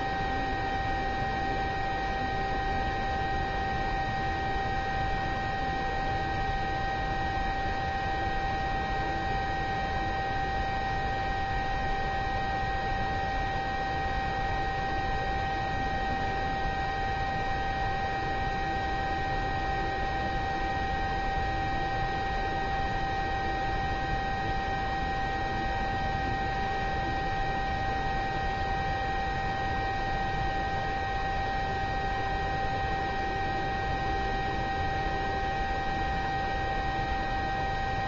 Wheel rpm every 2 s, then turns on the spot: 0, 0, 0, 0, 0, 0, 0, 0, 0, 0, 0, 0, 0, 0, 0, 0, 0, 0, 0.
none